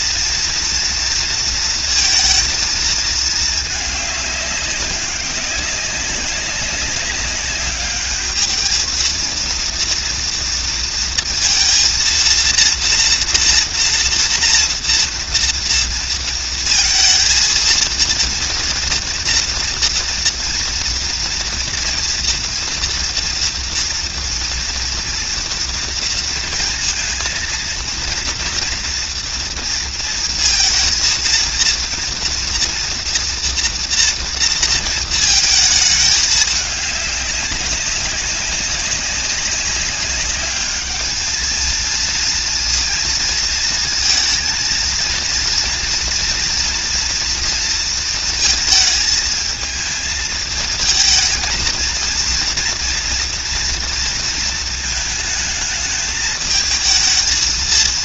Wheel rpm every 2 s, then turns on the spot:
230, 220, 200, 200, 220, 230, 240, 230, 220, 240, 240, 230, 230, 230, 230, 230, 230, 230, 210, 200, 210, 230, 230, 230, 220, 230, 230, 220, 220.
none